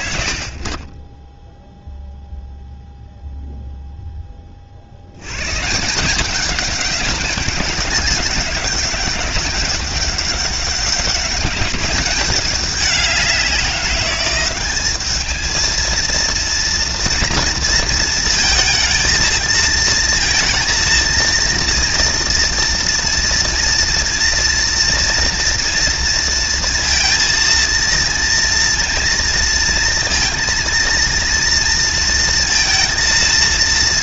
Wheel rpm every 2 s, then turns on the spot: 0, 0, 110, 200, 200, 200, 190, 220, 230, 230, 230, 230, 230, 230, 230, 230, 230.
none